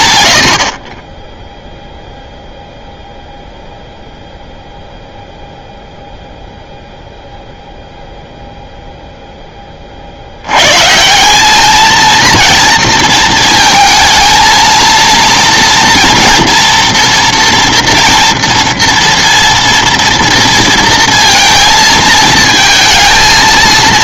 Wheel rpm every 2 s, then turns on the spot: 90, 0, 0, 0, 0, 100, 230, 230, 230, 230, 230, 220.
none